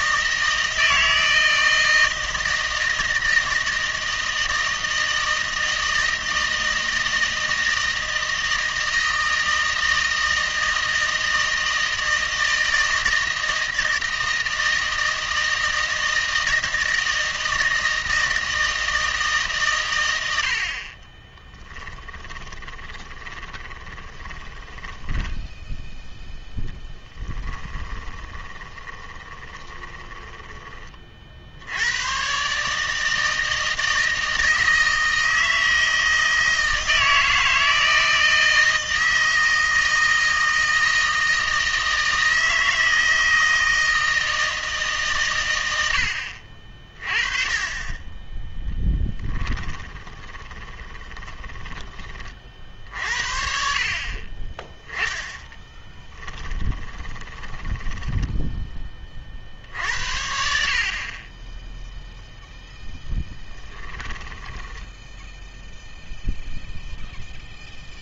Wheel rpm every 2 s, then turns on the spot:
160, 160, 160, 160, 160, 160, 160, 160, 160, 160, 50, 20, 10, 10, 20, 30, 150, 160, 160, 160, 160, 160, 160, 40, 10, 20, 50, 10, 20, 20, 50, 0, 10, 0.
22-30 48-52 56-58 64-66